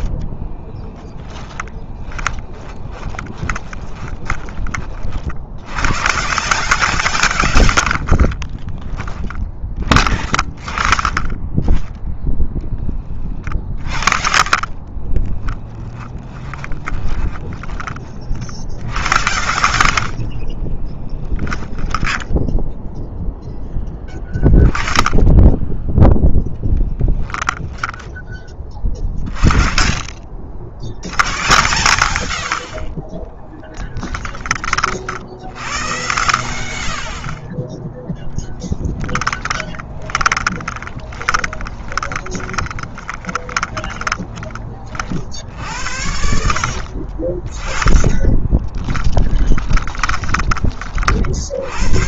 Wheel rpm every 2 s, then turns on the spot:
10, 20, 40, 140, 20, 20, 30, 30, 20, 70, 20, 0, 10, 10, 30, 90, 40, 50, 50, 10, 20, 30, 40, 50, 10, 40.
0-4 8-10 14-22 32-34 40-44 46-50